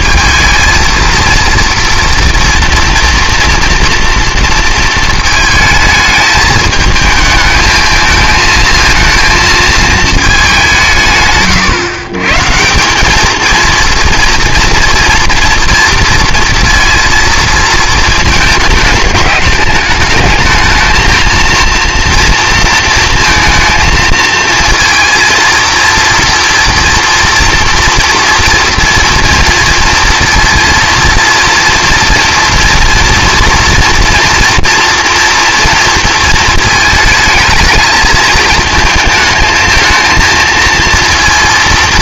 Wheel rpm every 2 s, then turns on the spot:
230, 230, 230, 220, 230, 180, 170, 230, 230, 220, 220, 230, 230, 230, 230, 230, 230, 230, 220, 220, 230.
none